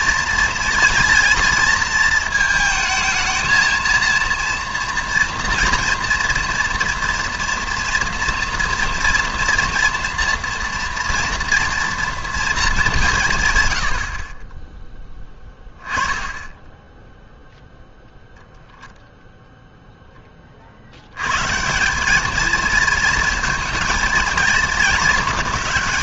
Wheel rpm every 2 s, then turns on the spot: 230, 220, 230, 230, 240, 230, 220, 20, 10, 0, 40, 220, 220.
none